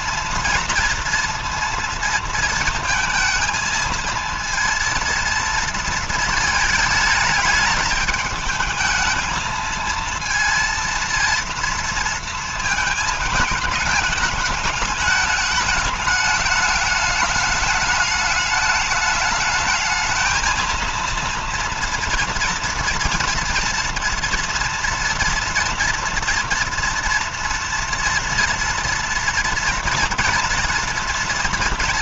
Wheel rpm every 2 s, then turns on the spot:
230, 230, 230, 220, 210, 230, 230, 210, 210, 210, 220, 230, 230, 240, 230, 230.
none